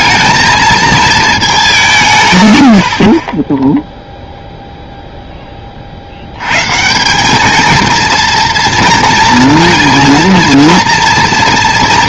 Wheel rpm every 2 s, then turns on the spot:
220, 110, 0, 110, 240, 230.
none